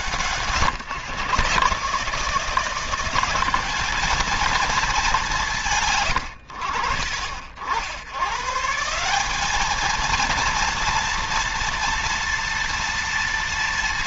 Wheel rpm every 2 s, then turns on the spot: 140, 180, 220, 50, 170, 230, 230.
none